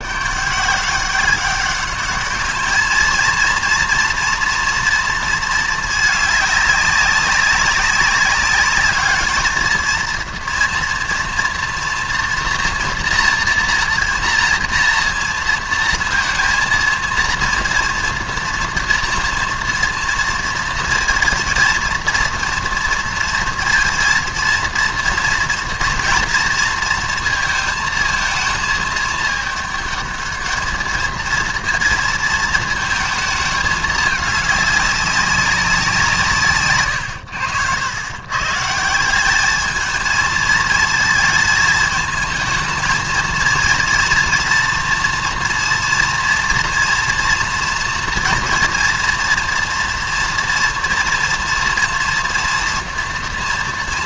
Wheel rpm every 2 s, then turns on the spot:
190, 210, 230, 210, 200, 230, 230, 230, 230, 230, 230, 230, 230, 230, 220, 210, 230, 210, 160, 120, 220, 220, 230, 230, 240, 230, 230.
none